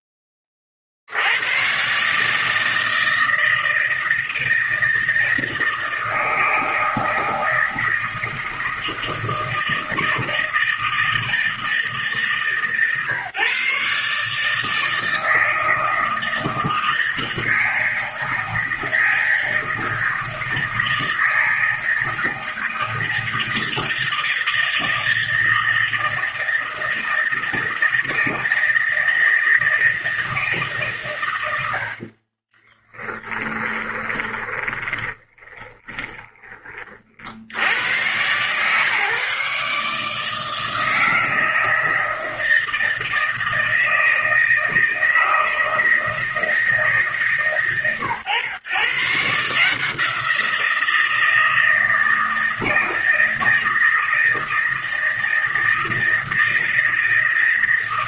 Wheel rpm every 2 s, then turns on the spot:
40, 160, 160, 160, 170, 160, 140, 160, 160, 160, 160, 160, 160, 160, 160, 120, 20, 20, 60, 140, 160, 160, 160, 150, 140, 160, 160, 160, 160.
32-36